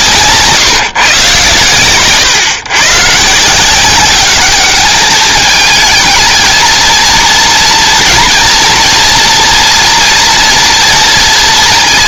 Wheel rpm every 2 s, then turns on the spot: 160, 120, 200, 230, 240, 230.
none